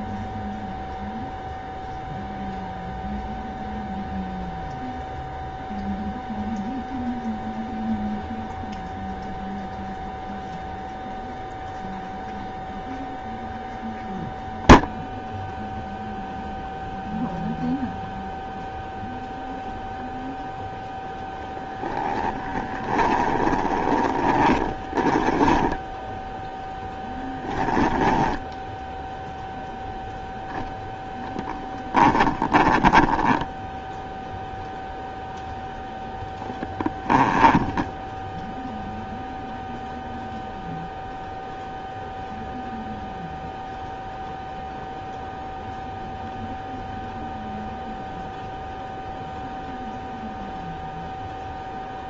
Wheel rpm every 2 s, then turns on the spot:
0, 0, 0, 0, 0, 0, 0, 0, 0, 0, 0, 10, 10, 10, 10, 0, 10, 0, 10, 0, 0, 0, 0, 0, 0, 0.
22-26 32-34 36-38